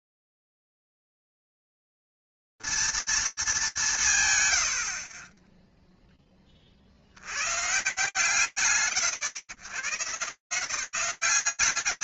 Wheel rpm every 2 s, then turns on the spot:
140, 230, 90, 30, 120, 210.
none